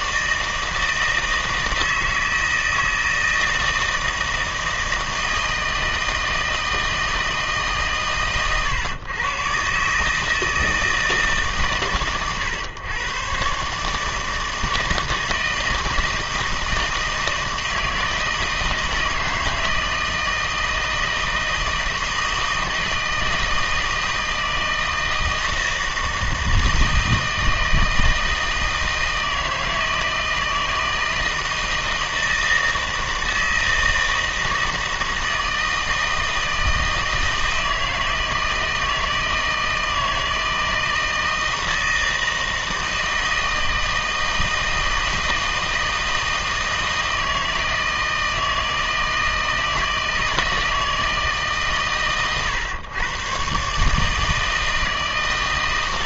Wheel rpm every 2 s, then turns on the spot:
160, 160, 160, 160, 120, 160, 110, 160, 160, 160, 160, 160, 160, 160, 160, 160, 160, 160, 160, 160, 160, 160, 160, 160, 160, 160, 120, 160.
none